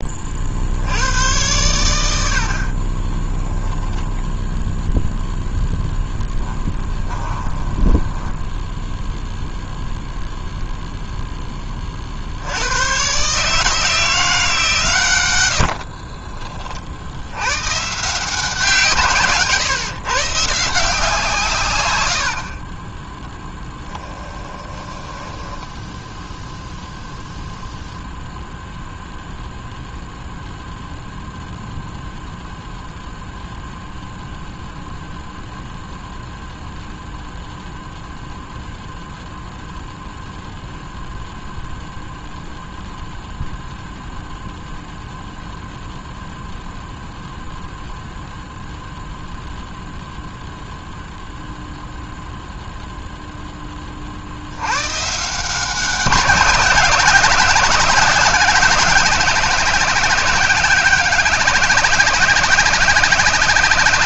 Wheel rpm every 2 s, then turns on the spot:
60, 60, 0, 10, 10, 0, 90, 160, 40, 150, 130, 40, 20, 0, 0, 0, 0, 0, 0, 0, 0, 0, 0, 0, 0, 0, 0, 80, 190, 190, 200, 200.
6-10 22-26